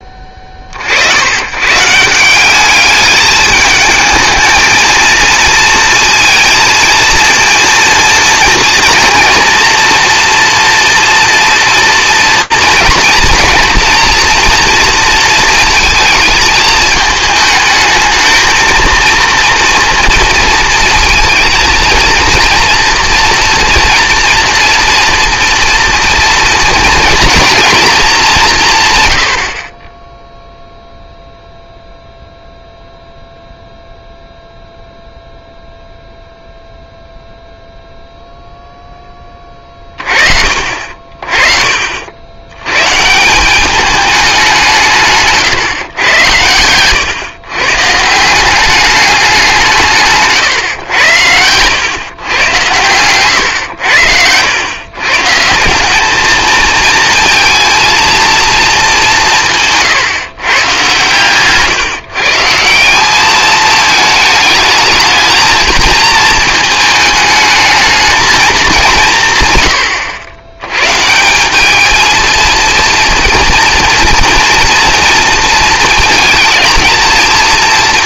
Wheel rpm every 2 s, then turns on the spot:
50, 200, 220, 230, 230, 230, 230, 230, 220, 230, 230, 230, 230, 230, 170, 0, 0, 0, 0, 0, 50, 110, 170, 110, 190, 130, 120, 110, 220, 220, 140, 170, 220, 220, 200, 130, 230, 230, 230.
46-48